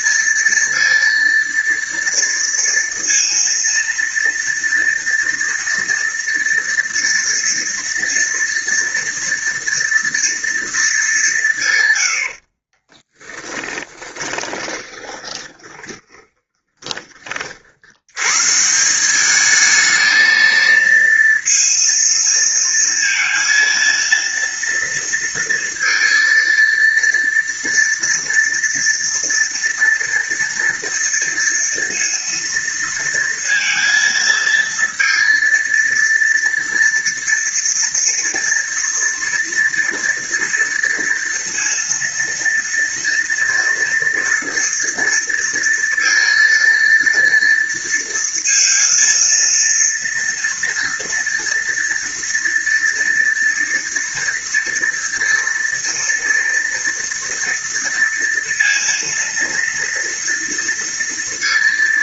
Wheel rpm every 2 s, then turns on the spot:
230, 230, 240, 230, 230, 220, 30, 20, 20, 150, 220, 230, 230, 230, 230, 230, 230, 230, 230, 230, 230, 230, 230, 230, 230, 230, 230, 230, 230, 230, 230.
12-18